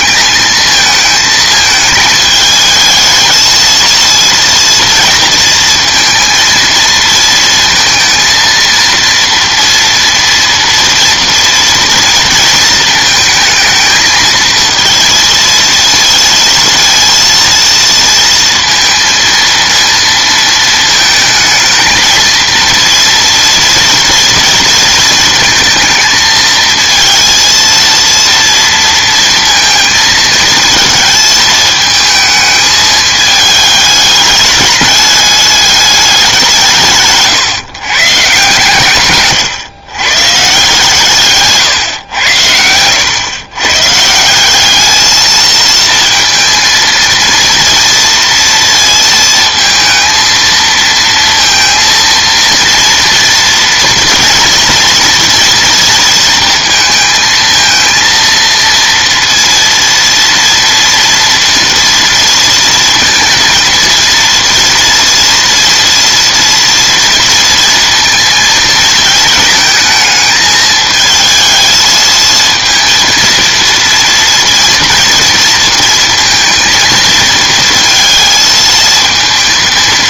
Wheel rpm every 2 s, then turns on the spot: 220, 220, 230, 230, 230, 230, 230, 230, 230, 230, 220, 230, 230, 220, 230, 220, 220, 210, 150, 130, 140, 100, 210, 230, 230, 230, 230, 230, 230, 230, 230, 230, 230, 230, 230, 220, 230, 230, 230, 220.
42-44